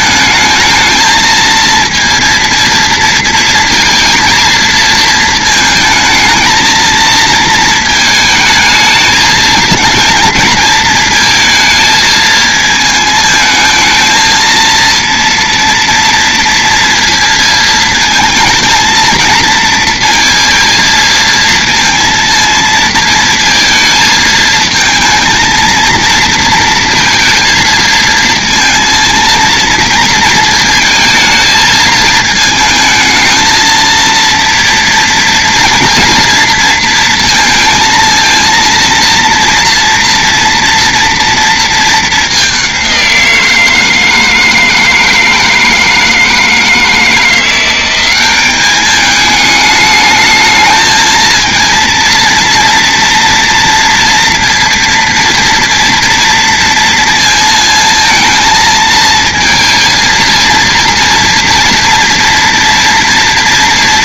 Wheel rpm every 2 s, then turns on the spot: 220, 230, 220, 230, 220, 220, 220, 230, 230, 230, 230, 230, 230, 230, 230, 220, 220, 230, 230, 230, 230, 190, 160, 160, 210, 220, 230, 230, 230, 230, 230, 230.
none